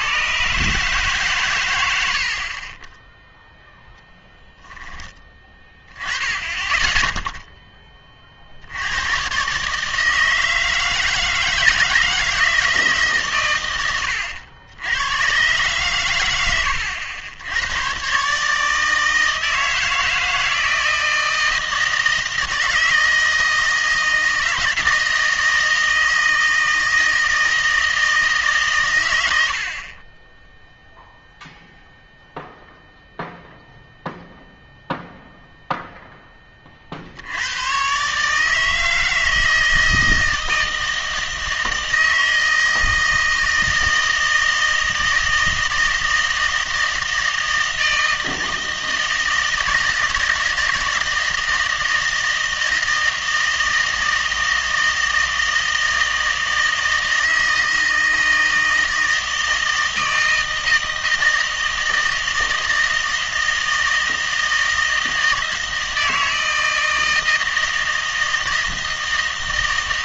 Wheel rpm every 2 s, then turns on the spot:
140, 30, 10, 20, 70, 160, 160, 80, 90, 150, 170, 160, 160, 160, 140, 0, 0, 0, 30, 160, 160, 160, 160, 160, 160, 160, 160, 160, 160, 160, 160, 160, 160, 160, 160.
none